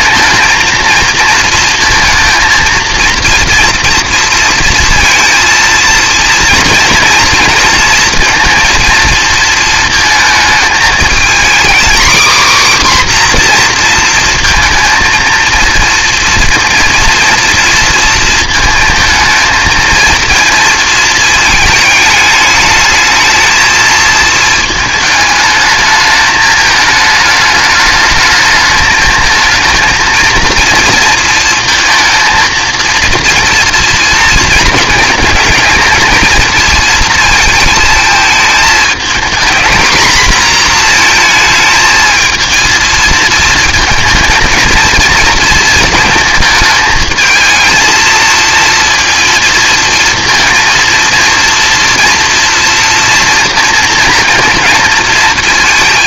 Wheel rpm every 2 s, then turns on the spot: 230, 230, 230, 230, 230, 220, 270, 230, 230, 230, 230, 220, 220, 210, 210, 230, 230, 220, 220, 220, 240, 220, 230, 220, 230, 230, 240, 230.
none